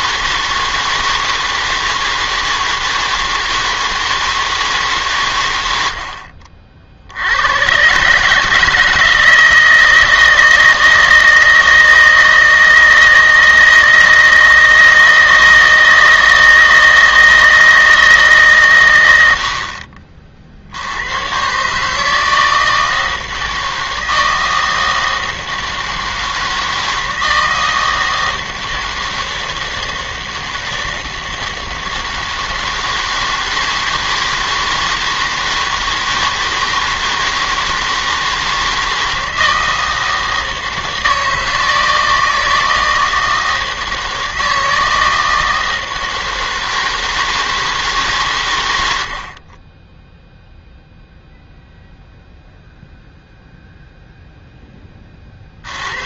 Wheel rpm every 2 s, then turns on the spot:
160, 160, 160, 50, 160, 160, 160, 160, 160, 130, 70, 160, 160, 160, 160, 160, 160, 160, 160, 160, 160, 160, 160, 160, 110, 0, 0, 10.
none